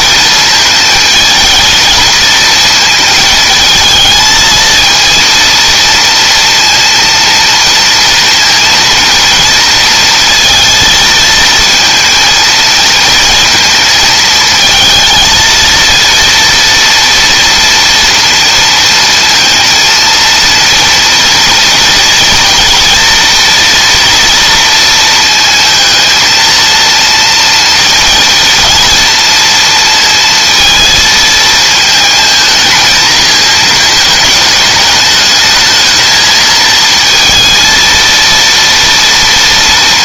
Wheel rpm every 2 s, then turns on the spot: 220, 220, 230, 230, 230, 230, 230, 220, 230, 230, 230, 230, 230, 230, 230, 220, 220, 210, 230, 230.
none